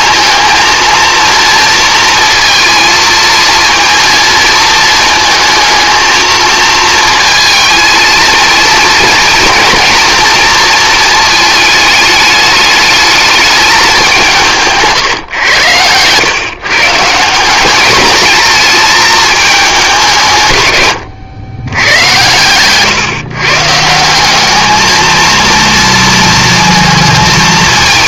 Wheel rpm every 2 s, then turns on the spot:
230, 230, 230, 230, 230, 220, 210, 160, 150, 220, 110, 130, 210, 230.
none